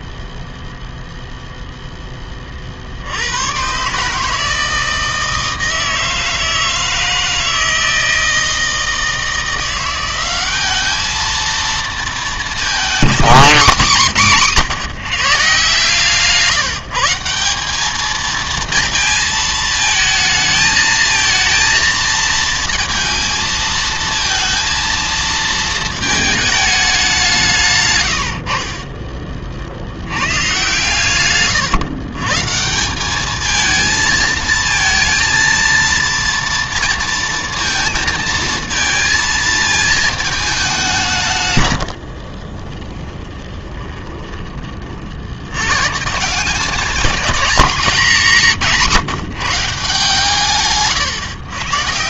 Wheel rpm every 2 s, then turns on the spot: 0, 50, 160, 160, 160, 210, 230, 190, 160, 230, 220, 220, 230, 210, 60, 120, 180, 220, 230, 220, 190, 20, 30, 190, 190, 140.
28-30 42-44 50-52